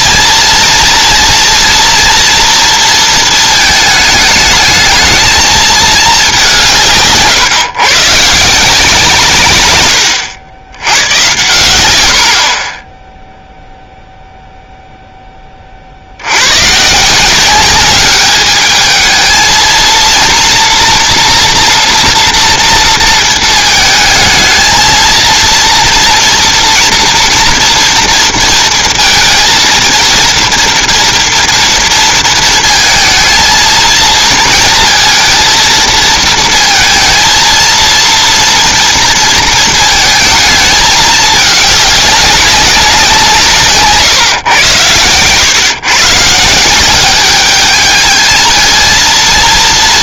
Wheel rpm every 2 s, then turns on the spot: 230, 230, 220, 150, 170, 110, 0, 10, 170, 220, 240, 230, 230, 230, 230, 230, 220, 220, 230, 230, 210, 180, 110, 200, 230.
none